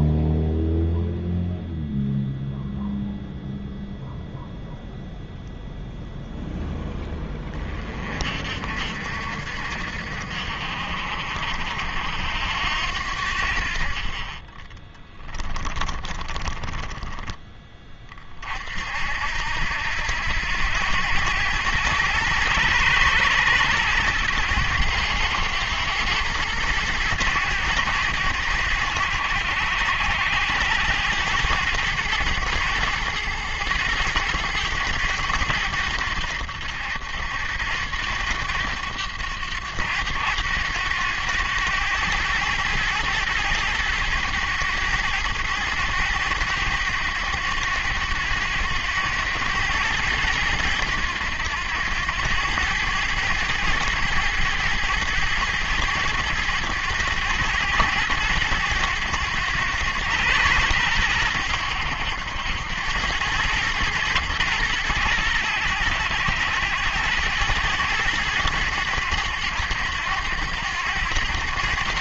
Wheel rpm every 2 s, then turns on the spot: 0, 0, 0, 10, 50, 60, 80, 30, 10, 50, 90, 110, 100, 110, 90, 100, 100, 110, 80, 100, 100, 110, 100, 100, 100, 100, 100, 110, 100, 100, 110, 90, 110, 100, 100, 100.
14-18